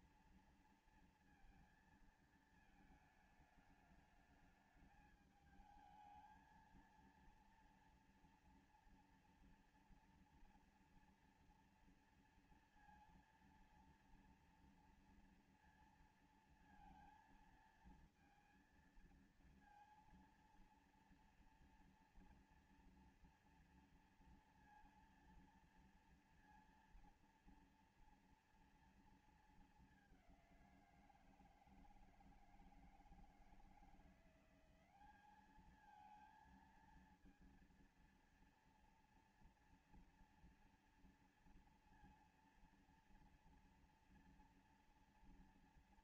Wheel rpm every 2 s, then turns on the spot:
230, 220, 210, 230, 230, 240, 230, 230, 230, 230, 230, 230, 230, 230, 230, 180, 160, 180, 230, 230, 230, 230, 230.
none